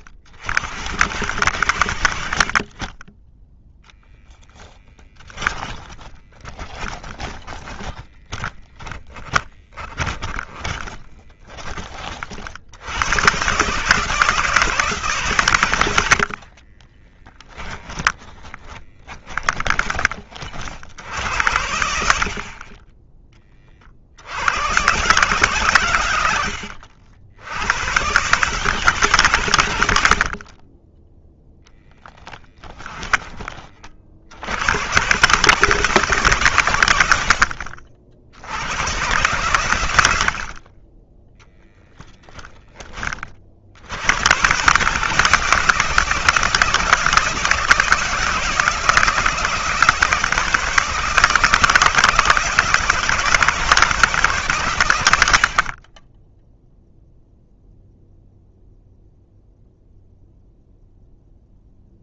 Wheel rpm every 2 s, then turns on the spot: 70, 20, 10, 20, 10, 20, 100, 150, 30, 20, 70, 20, 120, 90, 150, 30, 20, 110, 90, 110, 30, 30, 150, 170, 160, 160, 160, 90, 0, 0, 0.
4-12 16-20